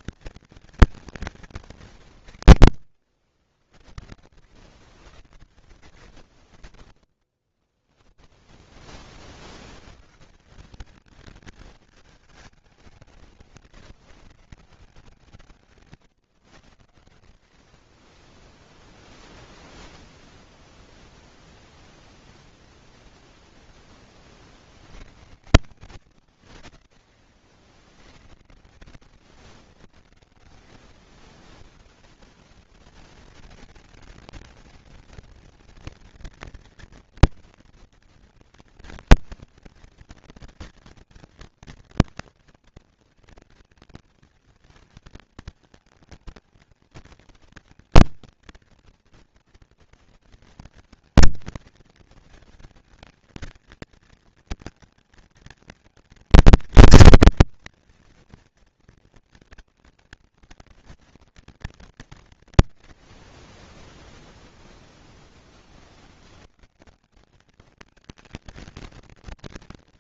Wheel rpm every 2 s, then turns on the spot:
170, 40, 80, 10, 40, 210, 180, 160, 90, 0, 0, 0, 90, 40, 100, 110, 210, 210, 230, 230, 230, 230, 230, 220, 230, 230, 220, 230, 230, 230, 230, 30, 10, 180, 230.
6-8